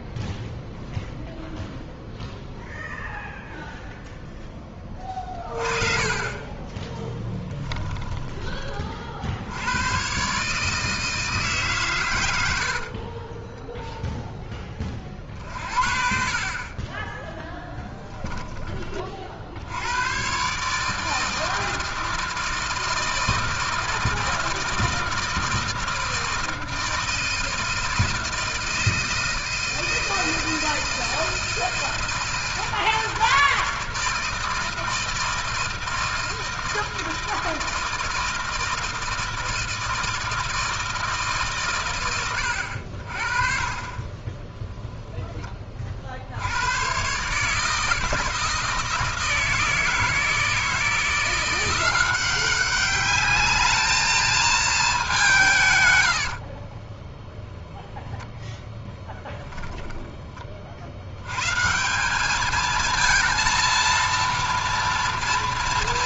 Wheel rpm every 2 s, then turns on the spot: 0, 0, 20, 20, 30, 150, 80, 30, 40, 10, 150, 160, 160, 160, 160, 160, 160, 160, 160, 160, 160, 80, 10, 130, 160, 160, 190, 210, 20, 10, 60, 220, 230.
6-8 12-14 16-18 44-46 56-60